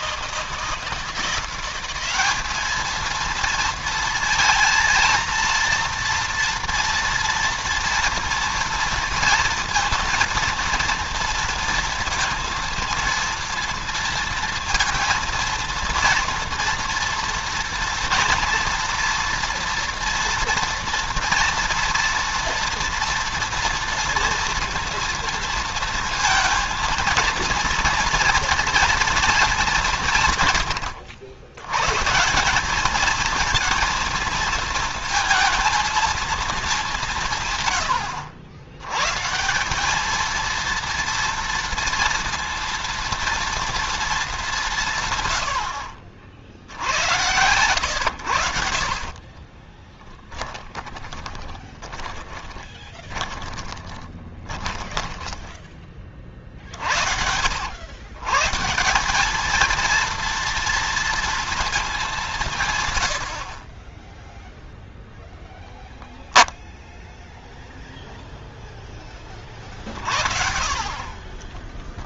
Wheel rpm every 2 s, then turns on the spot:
160, 220, 230, 230, 230, 230, 230, 230, 230, 230, 230, 230, 230, 230, 230, 100, 210, 230, 200, 100, 230, 230, 160, 90, 60, 20, 20, 10, 60, 160, 230, 120, 0, 0, 0, 30.
48-56